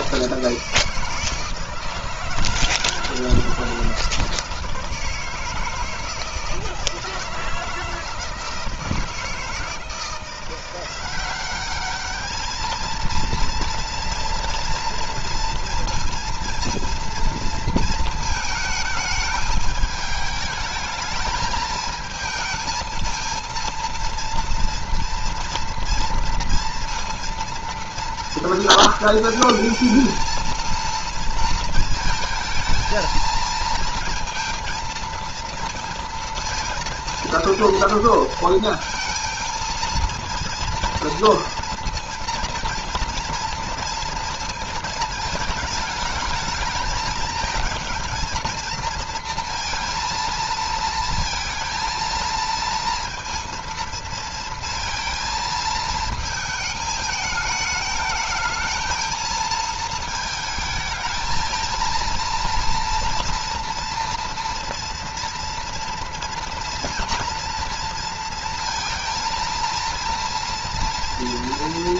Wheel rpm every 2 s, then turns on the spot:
160, 160, 160, 160, 160, 180, 220, 230, 230, 220, 220, 220, 230, 230, 230, 230, 220, 230, 230, 230, 230, 230, 220, 220, 230, 230, 230, 230, 220, 220, 220, 240, 230, 230, 230, 230.
none